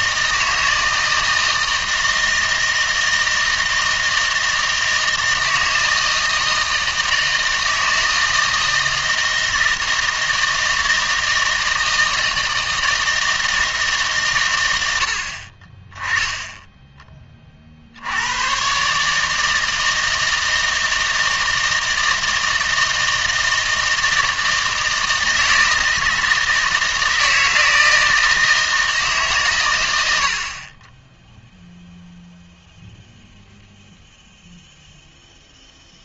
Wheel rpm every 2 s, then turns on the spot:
160, 160, 160, 160, 160, 160, 160, 90, 10, 130, 160, 160, 160, 160, 160, 30, 0, 0.
16-18